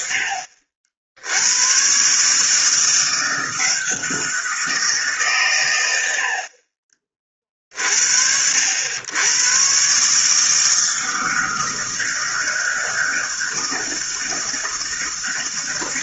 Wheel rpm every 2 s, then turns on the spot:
70, 150, 170, 40, 80, 160, 160, 160.
none